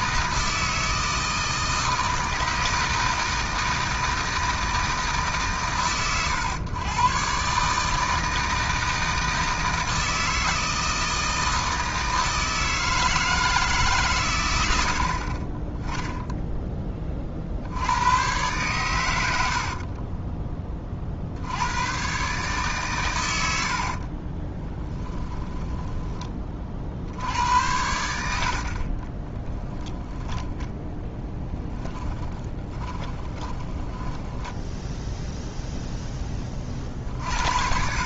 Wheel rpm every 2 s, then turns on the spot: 160, 160, 160, 110, 160, 160, 160, 70, 10, 110, 30, 130, 10, 70, 30, 10, 20, 10, 50.
24-26 32-36